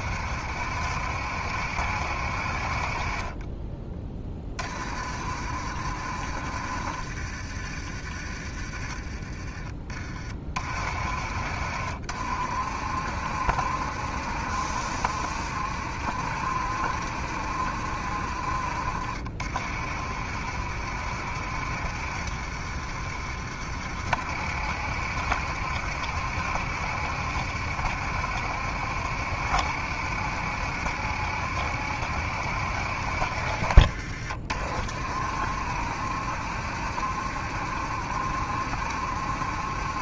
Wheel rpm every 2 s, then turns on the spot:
70, 50, 40, 60, 40, 40, 60, 70, 70, 60, 70, 70, 70, 70, 70, 70, 70, 60, 70, 70.
none